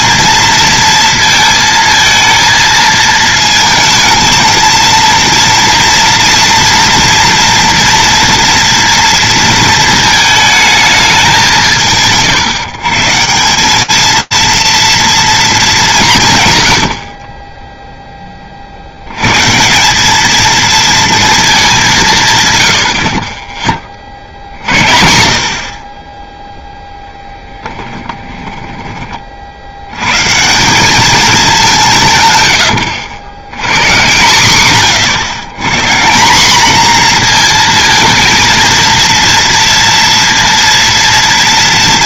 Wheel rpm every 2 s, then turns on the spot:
230, 230, 220, 240, 230, 220, 140, 230, 110, 50, 230, 120, 70, 0, 20, 180, 100, 130, 230, 230, 230.
32-34